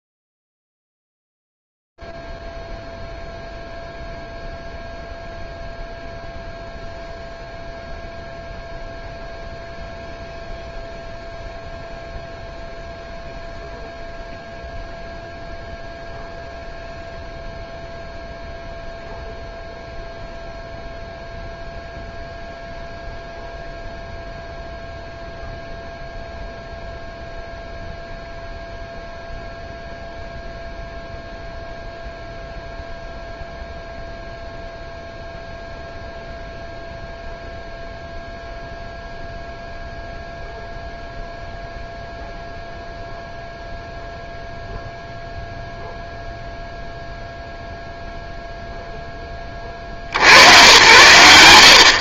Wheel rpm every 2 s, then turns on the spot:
0, 0, 0, 0, 0, 0, 0, 0, 0, 0, 0, 0, 0, 0, 0, 0, 0, 0, 0, 0, 0, 0, 0, 0, 0, 100.
none